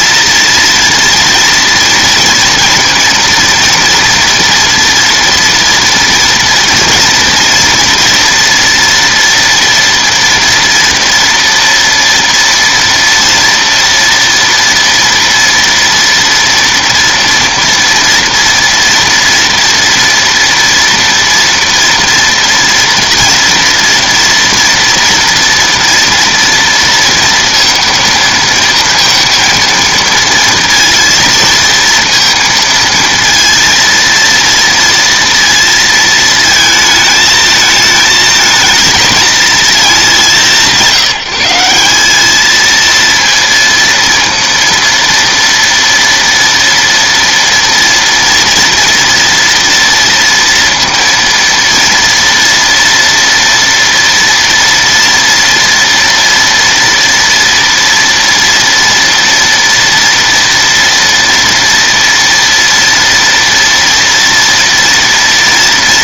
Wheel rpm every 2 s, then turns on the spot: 230, 230, 230, 230, 230, 230, 230, 230, 230, 230, 230, 230, 230, 230, 230, 230, 230, 230, 220, 220, 170, 210, 230, 230, 230, 230, 230, 230, 230, 230, 230, 230, 230.
none